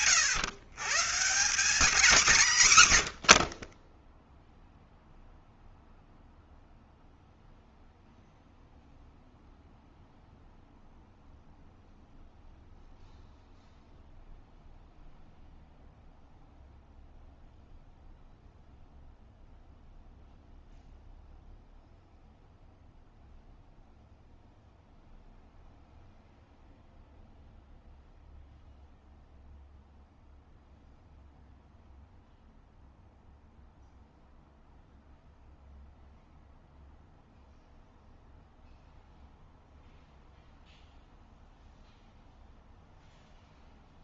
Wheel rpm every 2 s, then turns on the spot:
140, 140, 0, 0, 0, 0, 0, 0, 0, 0, 0, 0, 0, 0, 0, 0, 0, 0, 0, 0, 0, 0.
none